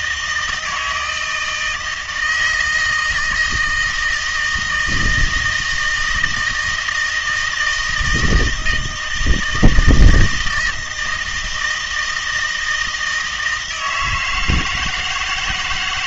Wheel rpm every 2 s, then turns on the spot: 160, 160, 160, 160, 160, 160, 160, 160.
none